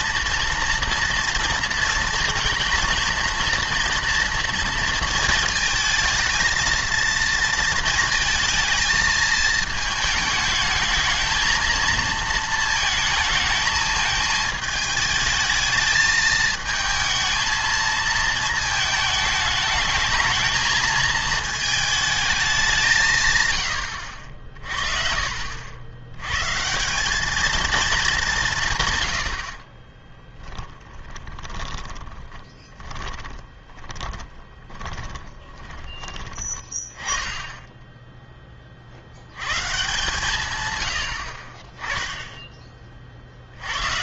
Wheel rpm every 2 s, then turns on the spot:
230, 230, 230, 220, 220, 220, 220, 220, 220, 220, 220, 190, 50, 160, 150, 20, 20, 20, 30, 40, 100, 20.
30-36